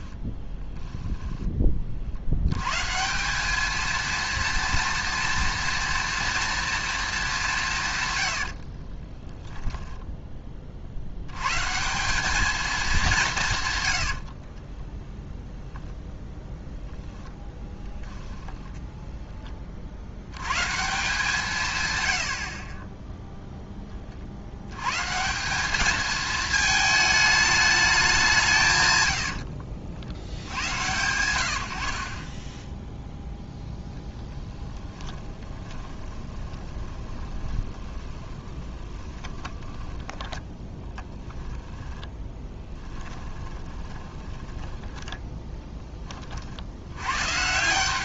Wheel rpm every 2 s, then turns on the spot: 10, 160, 230, 230, 40, 60, 210, 10, 0, 0, 150, 20, 140, 220, 100, 90, 0, 10, 20, 20, 10, 10, 10, 100.
0-2 8-10 14-16 34-46